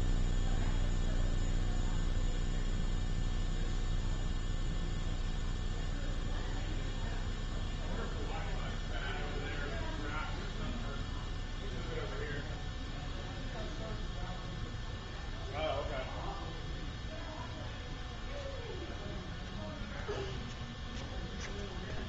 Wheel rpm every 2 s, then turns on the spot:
0, 0, 0, 0, 0, 0, 0, 0, 0, 0, 0.
none